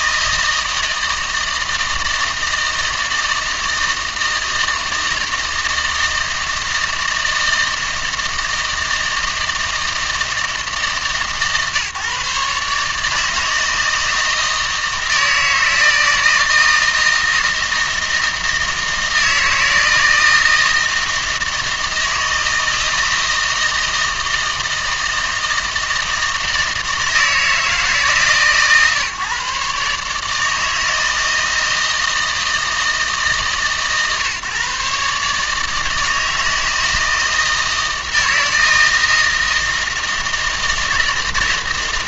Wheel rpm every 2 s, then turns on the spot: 160, 160, 160, 160, 160, 160, 150, 160, 160, 160, 160, 160, 160, 160, 140, 160, 160, 140, 160, 160, 160.
none